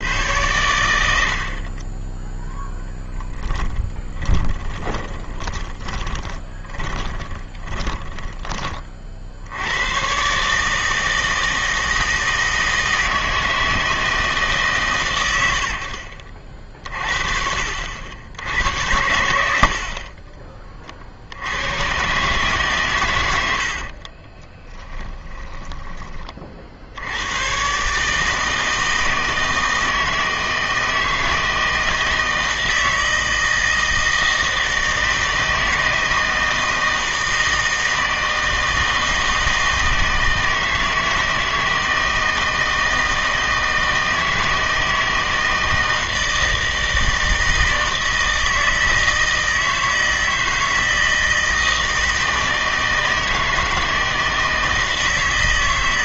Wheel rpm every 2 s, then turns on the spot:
100, 0, 20, 30, 30, 150, 160, 150, 50, 80, 40, 140, 20, 40, 160, 160, 160, 160, 160, 160, 160, 160, 160, 160, 160, 160, 160, 160.
4-8 24-26